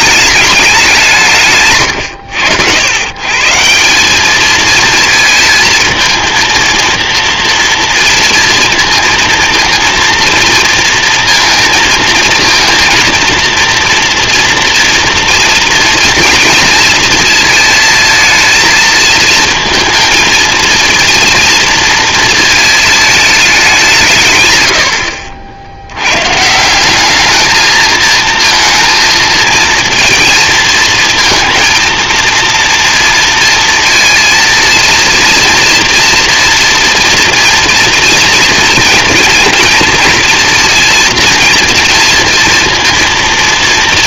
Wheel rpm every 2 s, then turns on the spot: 180, 110, 220, 230, 230, 230, 230, 230, 230, 220, 230, 220, 100, 190, 220, 230, 230, 230, 230, 230, 230, 230.
none